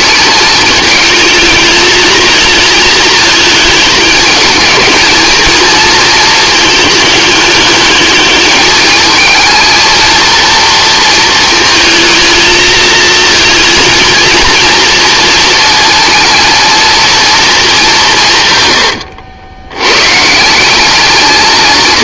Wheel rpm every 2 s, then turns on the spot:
220, 220, 220, 210, 220, 230, 220, 230, 230, 110, 190.
none